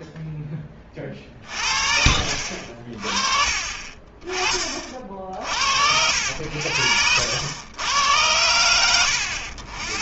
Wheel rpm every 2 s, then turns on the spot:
20, 40, 50, 80, 90.
none